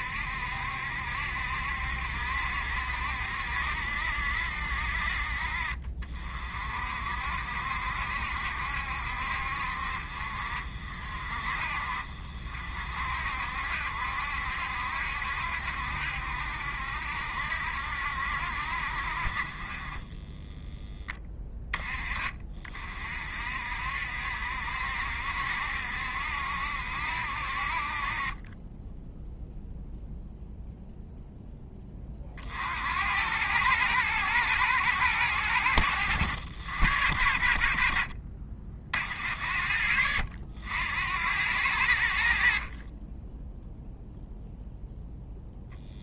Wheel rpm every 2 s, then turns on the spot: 70, 60, 60, 60, 70, 50, 50, 70, 70, 50, 10, 40, 60, 70, 10, 0, 80, 110, 90, 60, 80, 30, 0.
none